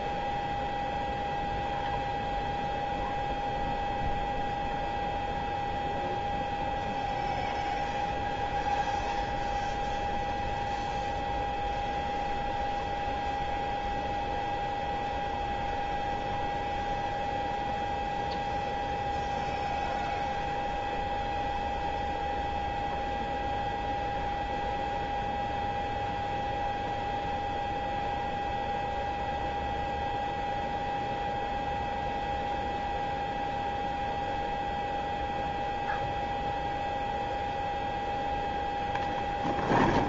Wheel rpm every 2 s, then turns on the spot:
0, 0, 0, 0, 0, 0, 0, 0, 0, 0, 0, 0, 0, 0, 0, 0, 0, 0, 0, 10.
none